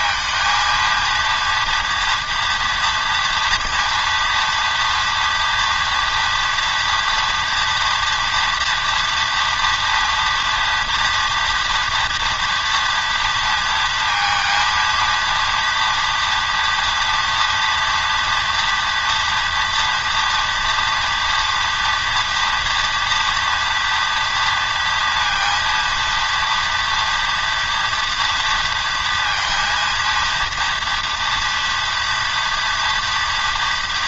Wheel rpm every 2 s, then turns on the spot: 230, 230, 230, 230, 230, 240, 230, 230, 230, 230, 230, 230, 230, 230, 230, 230, 230.
none